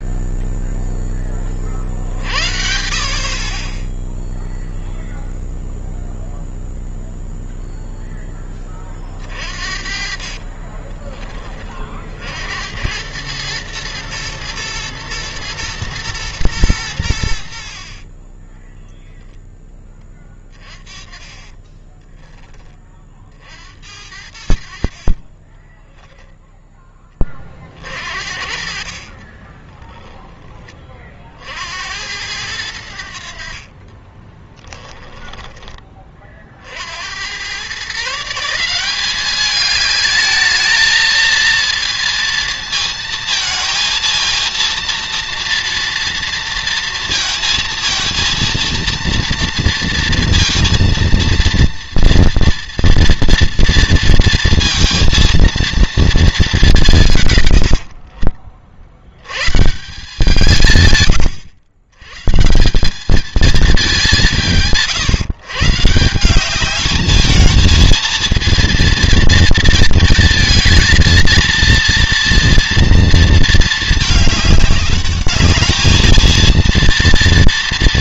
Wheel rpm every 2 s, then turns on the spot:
0, 50, 0, 0, 20, 20, 90, 120, 110, 10, 20, 30, 60, 20, 40, 30, 80, 10, 60, 180, 220, 230, 230, 230, 230, 230, 230, 230, 190, 70, 150, 180, 140, 200, 220, 230, 230, 210, 230.
10-12 18-22 24-26 28-30 34-36